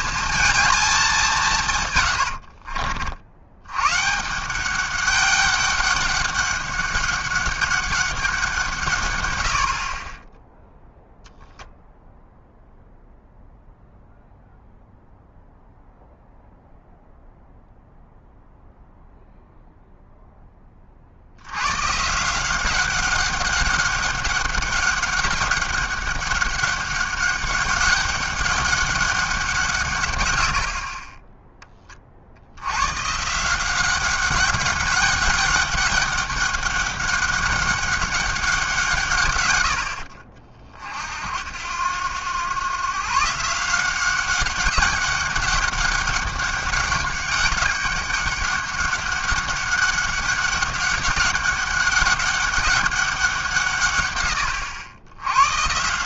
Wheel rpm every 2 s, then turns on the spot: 220, 60, 190, 200, 170, 10, 0, 0, 0, 0, 20, 180, 200, 200, 200, 70, 80, 190, 200, 180, 50, 120, 190, 200, 200, 200, 200, 110.
2-4